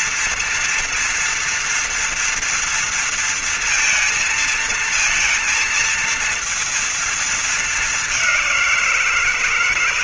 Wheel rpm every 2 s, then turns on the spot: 230, 230, 230, 230, 200.
none